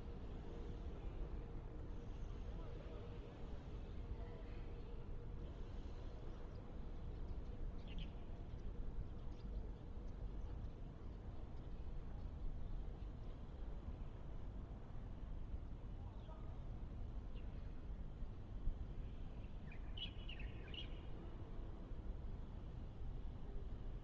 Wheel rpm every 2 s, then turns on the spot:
0, 0, 0, 0, 0, 0, 0, 0, 0, 0, 0, 0.
none